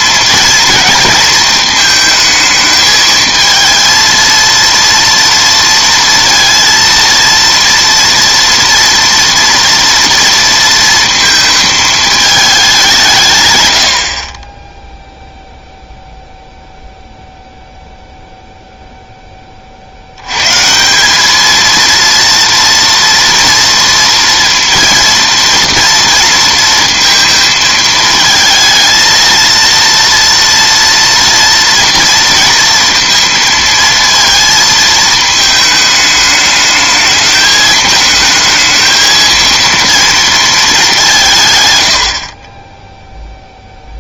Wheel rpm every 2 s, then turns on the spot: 230, 220, 230, 230, 230, 230, 190, 10, 0, 0, 170, 230, 230, 230, 230, 240, 230, 220, 220, 220, 210, 10.
none